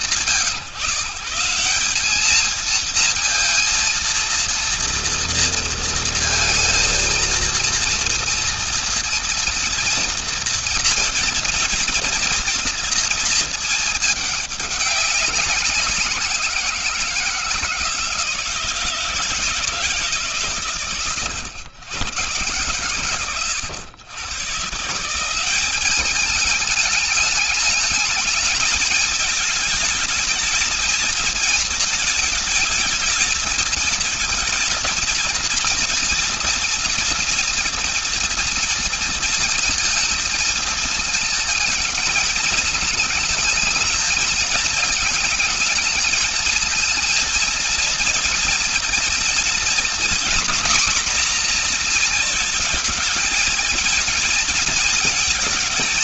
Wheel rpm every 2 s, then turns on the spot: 150, 220, 230, 230, 230, 230, 230, 210, 170, 170, 140, 120, 160, 210, 220, 220, 220, 230, 230, 230, 220, 220, 220, 220, 230, 250, 230, 230.
none